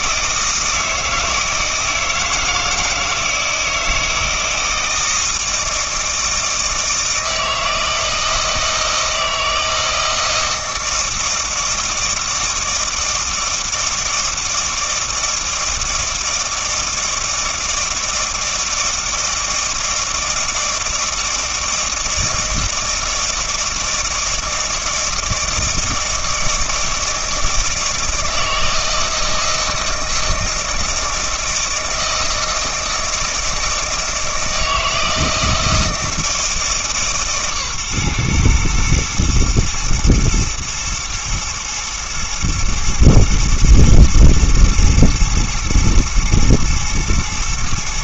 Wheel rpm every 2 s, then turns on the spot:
160, 160, 160, 160, 160, 160, 160, 160, 160, 160, 160, 160, 160, 160, 160, 160, 160, 160, 160, 110, 110, 120, 120, 110.
none